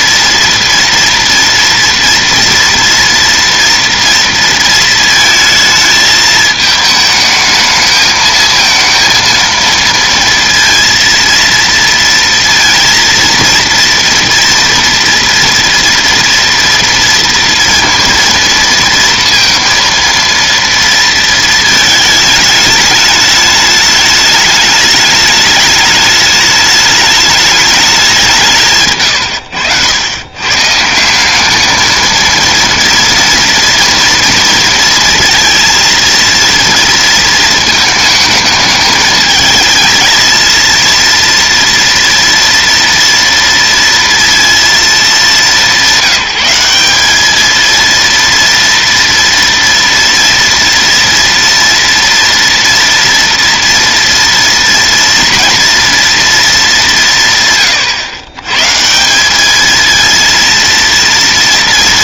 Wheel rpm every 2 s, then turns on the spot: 230, 230, 230, 220, 230, 230, 230, 240, 230, 230, 230, 210, 210, 210, 150, 140, 230, 230, 230, 220, 230, 230, 230, 180, 230, 230, 230, 230, 200, 150, 230.
28-30